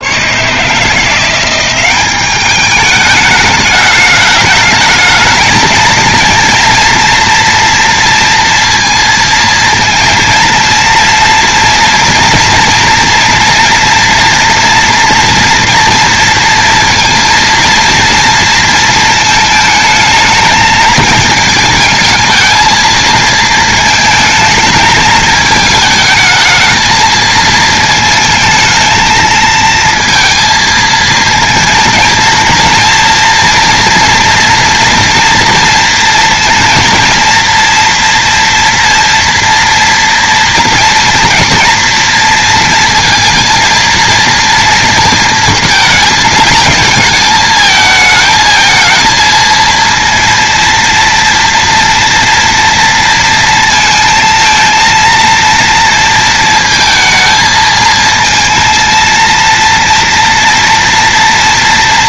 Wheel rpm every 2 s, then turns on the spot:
170, 210, 220, 230, 230, 230, 230, 240, 230, 220, 220, 220, 220, 220, 220, 230, 230, 230, 230, 230, 230, 230, 230, 220, 220, 230, 230, 230, 220, 230, 240.
none